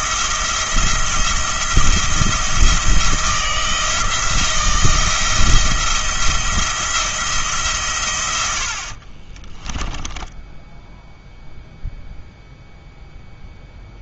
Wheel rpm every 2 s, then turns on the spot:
170, 170, 170, 170, 60, 0, 0.
8-10